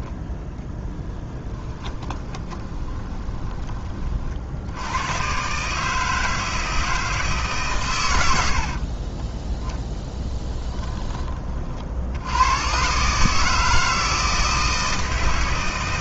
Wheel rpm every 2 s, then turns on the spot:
20, 20, 90, 160, 60, 20, 130, 160.
0-4 8-12